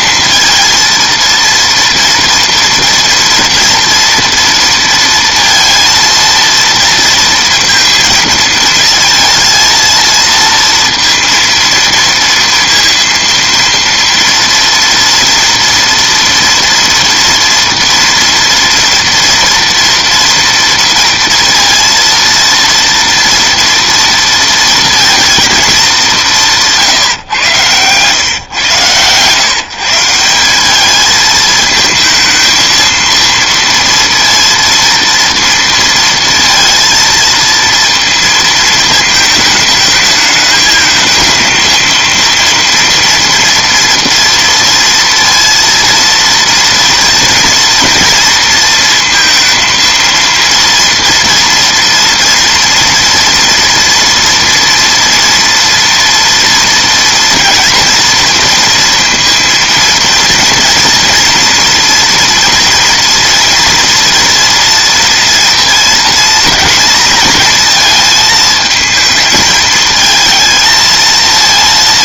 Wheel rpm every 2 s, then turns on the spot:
230, 230, 230, 230, 230, 230, 230, 230, 230, 230, 230, 230, 230, 170, 130, 200, 230, 230, 230, 230, 220, 230, 230, 230, 230, 230, 230, 230, 230, 230, 230, 230, 230, 230, 220, 220.
none